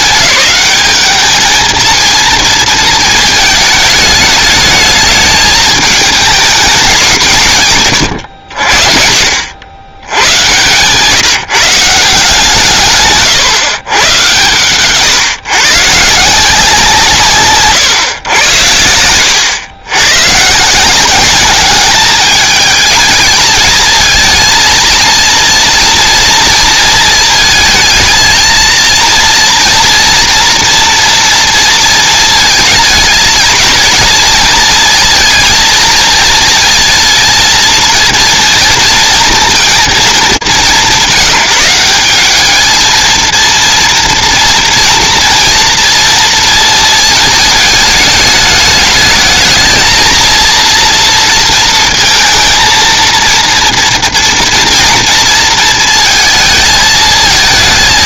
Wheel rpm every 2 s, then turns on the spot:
200, 220, 210, 220, 80, 120, 170, 120, 160, 100, 150, 210, 230, 230, 230, 240, 220, 230, 230, 230, 190, 210, 230, 230, 210, 230, 230, 230, 220.
none